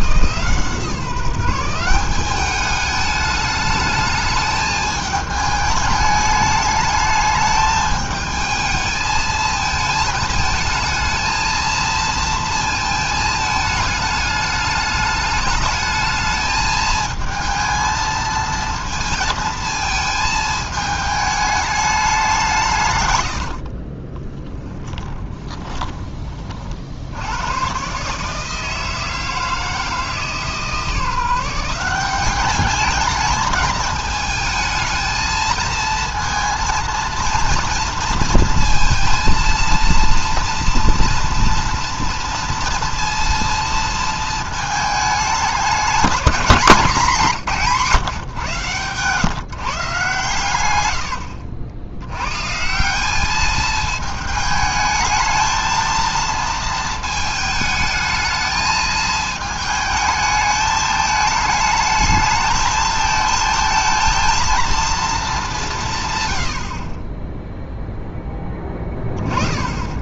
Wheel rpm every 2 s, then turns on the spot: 160, 210, 220, 210, 220, 220, 230, 210, 220, 230, 220, 150, 10, 50, 160, 160, 210, 220, 230, 230, 240, 230, 220, 210, 130, 100, 170, 220, 230, 220, 220, 220, 230, 50, 10.
24-26 66-68